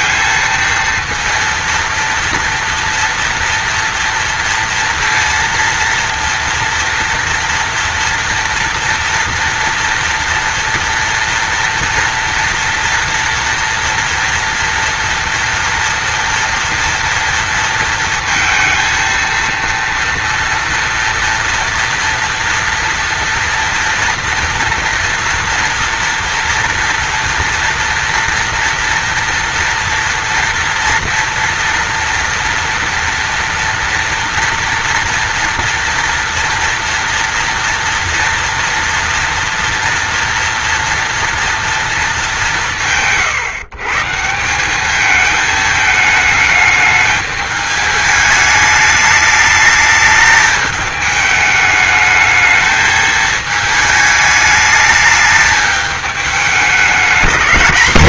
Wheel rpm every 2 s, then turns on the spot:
230, 230, 230, 230, 230, 230, 230, 230, 230, 230, 230, 230, 230, 240, 240, 230, 230, 230, 240, 230, 230, 130, 200, 210, 210, 220, 220, 210, 210.
none